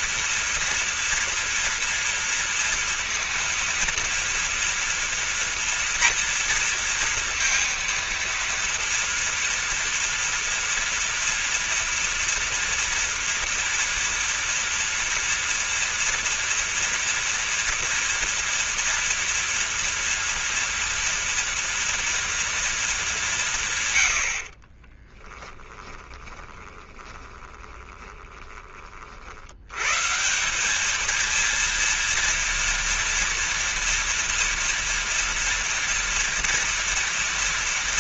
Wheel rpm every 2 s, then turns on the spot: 230, 230, 230, 230, 230, 230, 230, 230, 230, 230, 230, 210, 40, 20, 30, 200, 230, 230, 230.
24-28